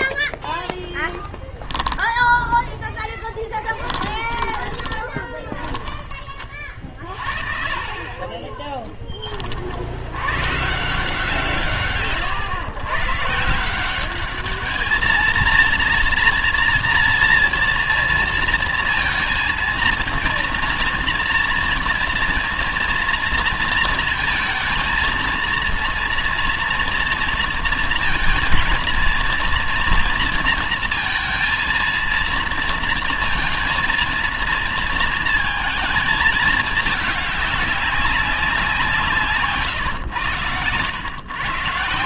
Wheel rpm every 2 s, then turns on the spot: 0, 0, 20, 30, 20, 130, 120, 210, 240, 230, 230, 230, 230, 230, 230, 230, 230, 230, 220, 190, 110.
4-6 8-10